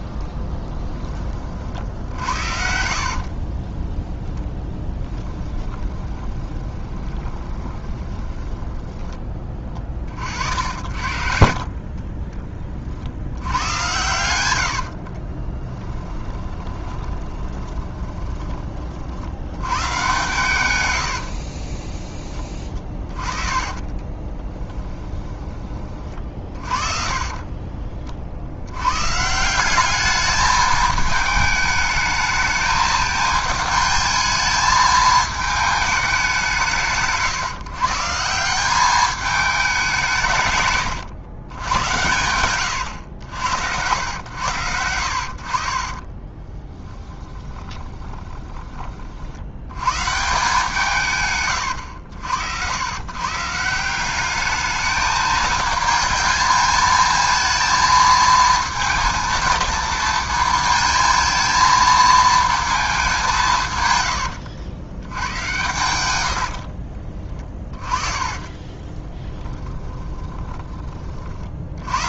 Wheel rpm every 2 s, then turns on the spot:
10, 60, 10, 20, 10, 60, 30, 80, 20, 30, 120, 20, 20, 30, 90, 210, 220, 220, 150, 190, 130, 110, 80, 10, 20, 160, 100, 210, 220, 230, 220, 220, 90, 60, 20, 30.
6-8 14-18 22-26 46-48 66-70